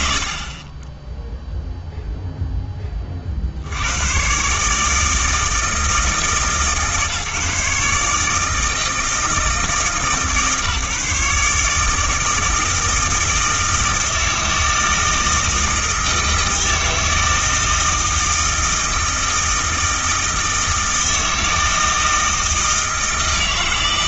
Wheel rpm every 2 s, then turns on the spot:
60, 10, 130, 160, 160, 150, 160, 160, 160, 160, 160, 160.
none